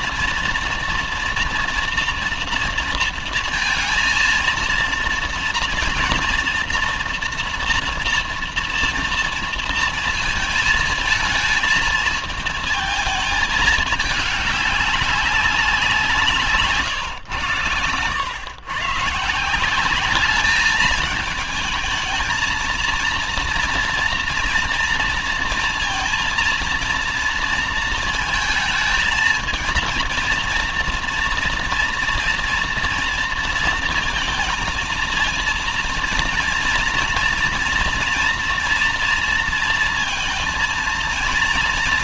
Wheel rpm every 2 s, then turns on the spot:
230, 230, 230, 230, 230, 230, 230, 210, 160, 120, 210, 230, 230, 230, 230, 230, 230, 230, 230, 230, 230.
none